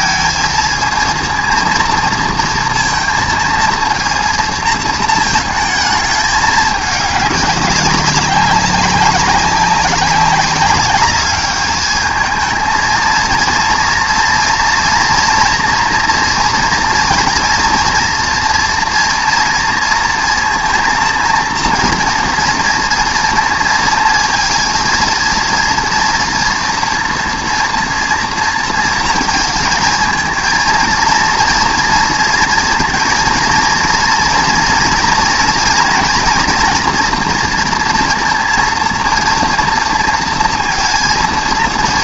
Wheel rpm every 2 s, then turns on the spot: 230, 230, 230, 210, 200, 200, 220, 240, 230, 230, 230, 230, 230, 230, 230, 230, 230, 230, 240, 230, 230.
none